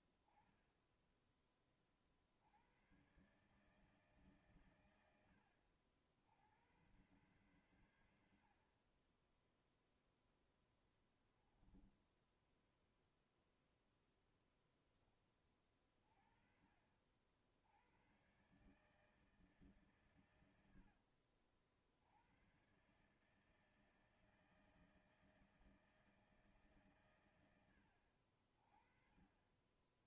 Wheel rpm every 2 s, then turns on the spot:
40, 70, 130, 80, 70, 10, 10, 0, 40, 120, 120, 100, 160, 160, 70.
12-14 20-22